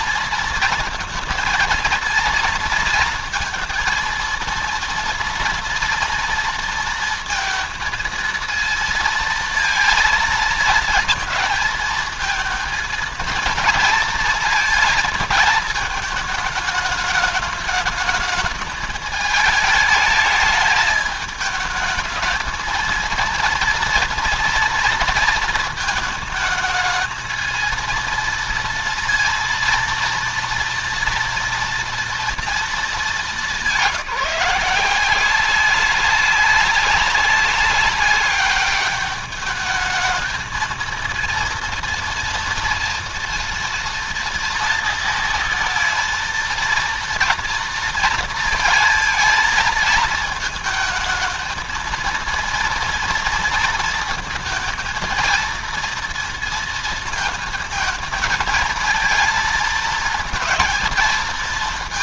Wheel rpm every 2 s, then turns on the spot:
230, 230, 230, 230, 230, 220, 220, 230, 220, 220, 210, 230, 230, 220, 230, 230, 220, 170, 190, 200, 230, 240, 230, 230, 230, 220, 230, 230, 230, 220, 230.
none